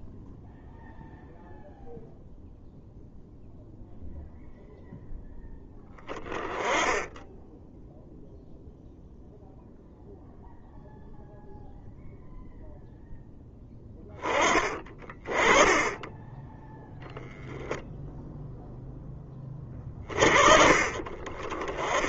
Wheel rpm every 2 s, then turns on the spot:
0, 0, 0, 10, 0, 0, 0, 30, 0, 10, 40.
none